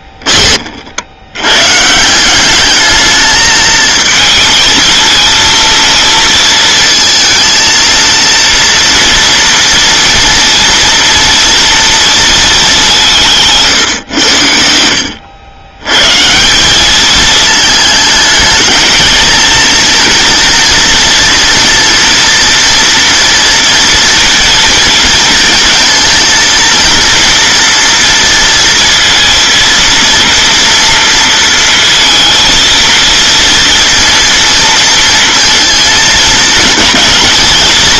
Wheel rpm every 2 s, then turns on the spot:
40, 210, 220, 230, 230, 230, 200, 70, 190, 220, 230, 230, 220, 230, 230, 230, 230, 230, 220.
none